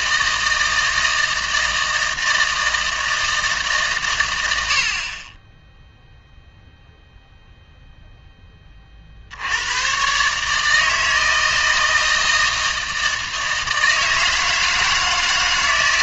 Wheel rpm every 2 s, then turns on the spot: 160, 160, 60, 0, 40, 160, 160, 160.
none